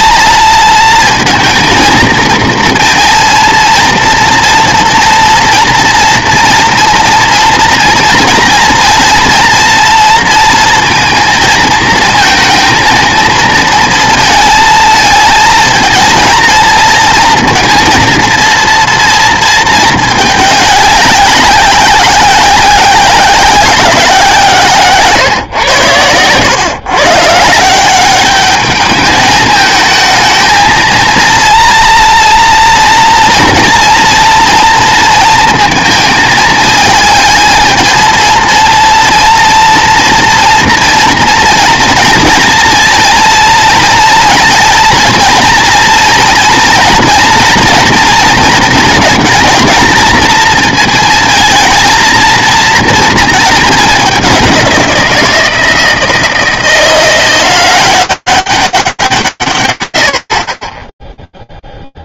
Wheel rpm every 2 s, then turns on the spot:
230, 230, 230, 230, 230, 230, 230, 220, 230, 230, 210, 190, 160, 120, 210, 220, 230, 230, 220, 230, 230, 230, 230, 230, 230, 220, 230, 190, 160, 200, 60.
none